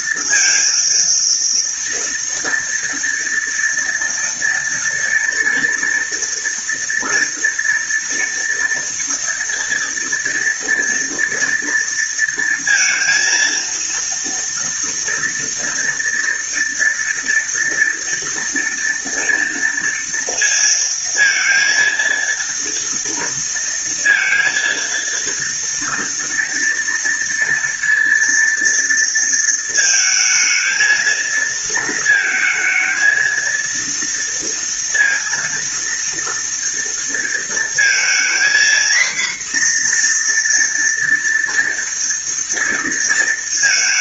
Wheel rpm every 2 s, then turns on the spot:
230, 230, 230, 230, 230, 230, 230, 230, 230, 230, 230, 230, 230, 230, 230, 220, 220, 240, 230, 230, 240, 230.
none